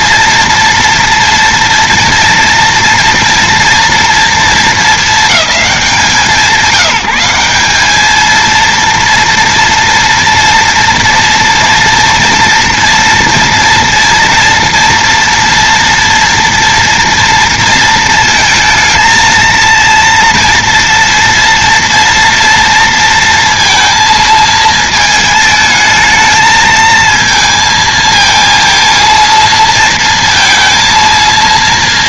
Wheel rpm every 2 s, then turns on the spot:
230, 230, 230, 170, 230, 230, 230, 230, 230, 220, 240, 230, 220, 220, 220, 230.
none